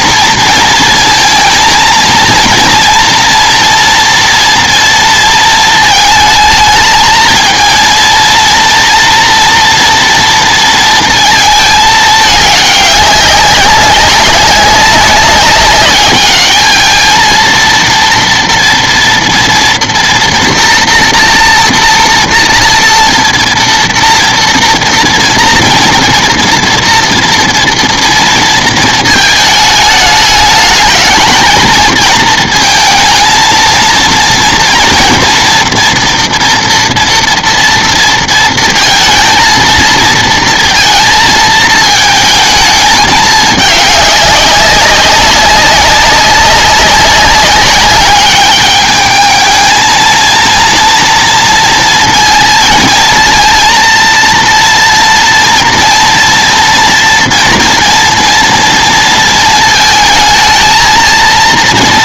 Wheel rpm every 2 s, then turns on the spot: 220, 230, 230, 220, 240, 230, 210, 200, 220, 240, 240, 230, 230, 230, 230, 220, 230, 230, 230, 230, 230, 220, 190, 200, 210, 230, 230, 230, 240, 230, 220.
none